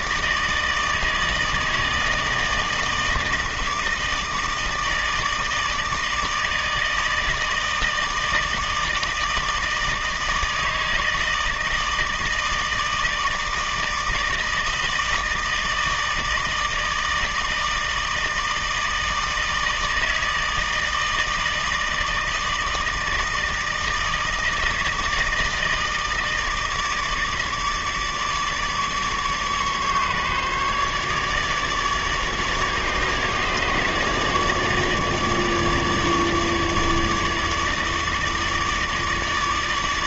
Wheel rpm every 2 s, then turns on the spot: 160, 160, 160, 150, 160, 160, 160, 160, 160, 160, 160, 160, 160, 160, 150, 150, 150, 150, 150, 150.
none